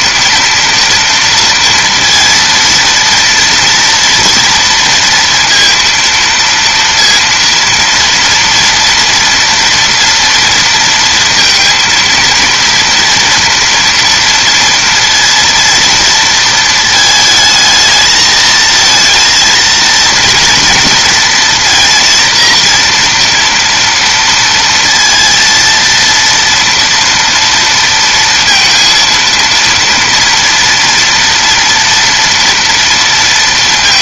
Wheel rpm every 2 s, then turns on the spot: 230, 230, 230, 230, 230, 230, 230, 230, 220, 220, 230, 230, 230, 230, 230, 230, 230.
none